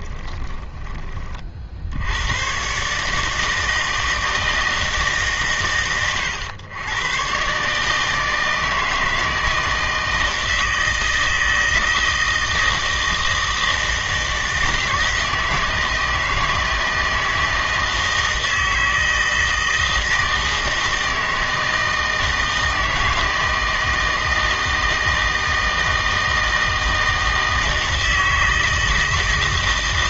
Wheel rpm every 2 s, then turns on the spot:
20, 130, 160, 120, 160, 160, 160, 160, 160, 160, 160, 160, 160, 160, 160.
none